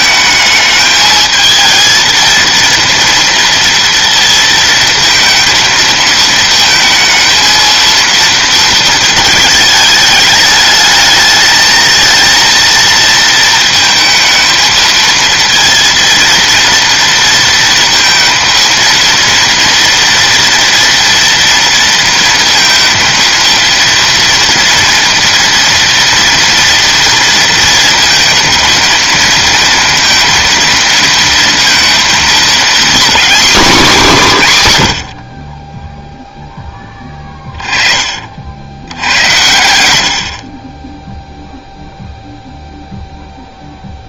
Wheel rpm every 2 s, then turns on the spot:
220, 230, 230, 230, 220, 220, 230, 230, 230, 230, 240, 230, 240, 230, 230, 230, 240, 90, 10, 80, 20, 0.
none